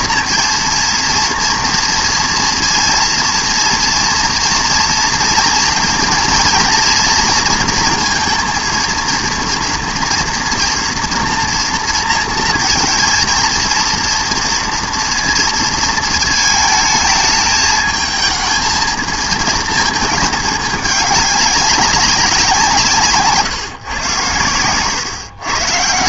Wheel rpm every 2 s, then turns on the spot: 230, 230, 230, 230, 230, 230, 230, 230, 220, 220, 210, 170, 110.
none